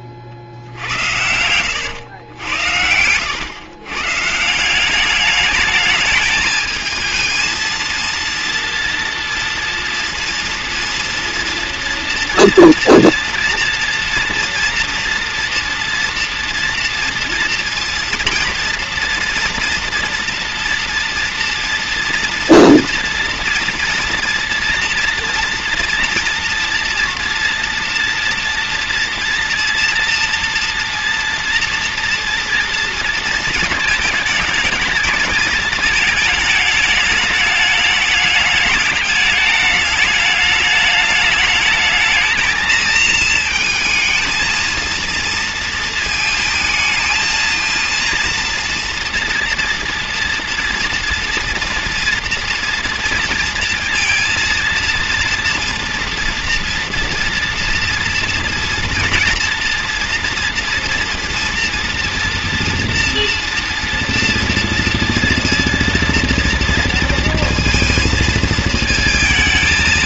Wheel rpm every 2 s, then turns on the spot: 60, 90, 160, 220, 230, 230, 230, 230, 230, 230, 230, 230, 230, 230, 230, 230, 230, 210, 210, 210, 210, 220, 230, 220, 230, 240, 240, 230, 240, 230, 230, 230, 230, 230, 220.
0-4